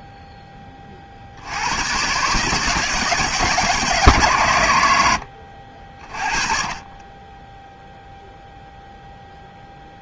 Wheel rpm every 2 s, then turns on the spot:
10, 140, 140, 30, 0.
none